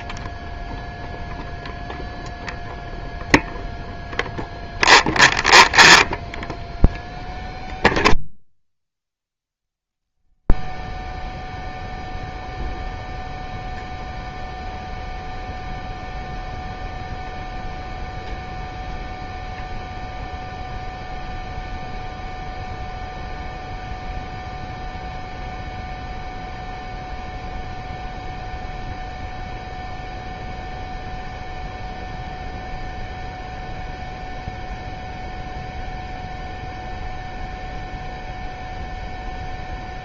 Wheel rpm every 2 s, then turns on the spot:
0, 0, 0, 0, 0, 0, 0, 0, 0, 0, 0, 0, 0, 0, 0, 0, 0, 0, 0, 0.
none